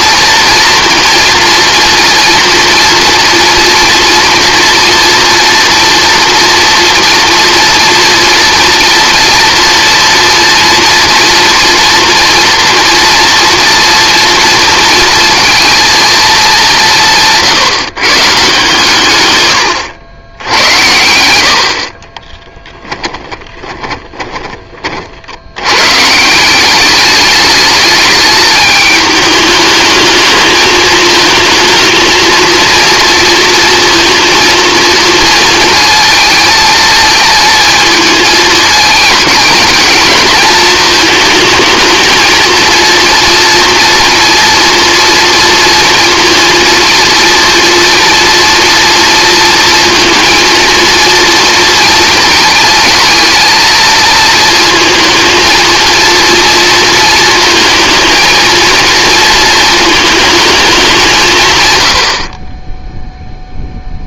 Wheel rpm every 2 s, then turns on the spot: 230, 230, 230, 230, 230, 230, 230, 230, 190, 150, 80, 10, 30, 200, 210, 220, 230, 230, 220, 220, 220, 230, 230, 230, 230, 230, 220, 230, 230, 230, 210, 20.
20-24